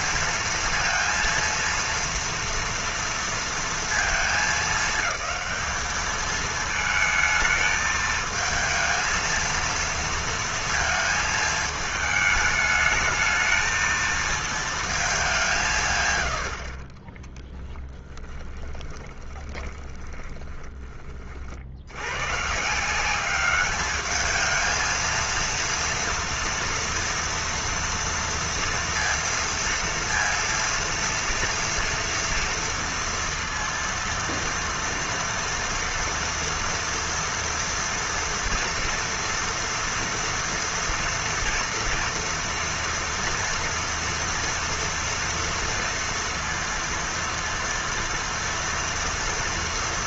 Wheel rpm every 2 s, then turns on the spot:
230, 240, 220, 220, 220, 230, 210, 220, 80, 20, 20, 130, 220, 230, 230, 230, 230, 230, 230, 230, 230, 230, 230, 230, 240.
18-22